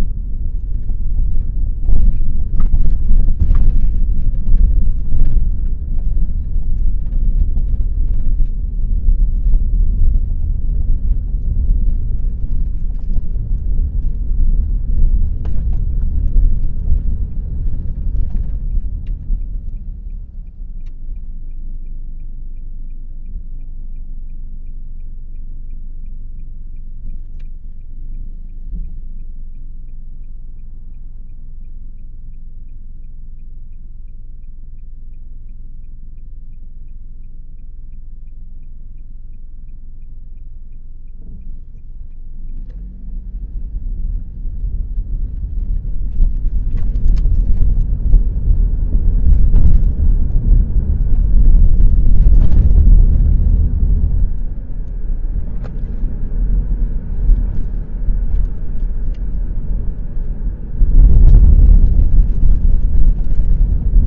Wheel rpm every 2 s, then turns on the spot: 0, 0, 0, 0, 0, 0, 0, 0, 0, 0, 0, 0, 0, 0, 0, 0, 0, 0, 0, 0, 0, 0, 0, 0, 0, 0, 0, 0, 0, 0, 0, 0.
none